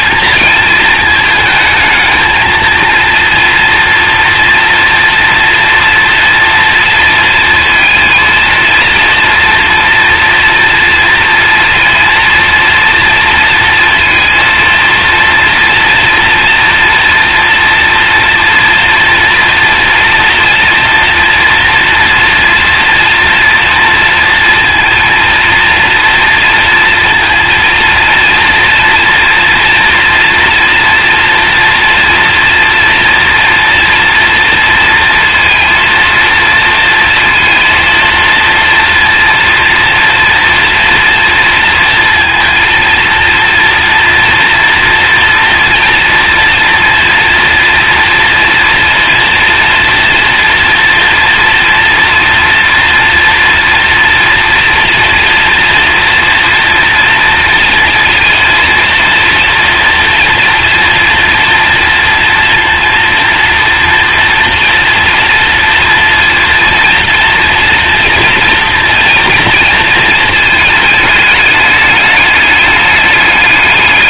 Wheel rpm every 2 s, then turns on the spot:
220, 220, 230, 230, 220, 230, 230, 230, 240, 230, 230, 240, 230, 230, 230, 230, 230, 230, 230, 230, 230, 230, 230, 240, 240, 230, 230, 230, 230, 230, 240, 230, 230, 230, 230, 230, 210.
none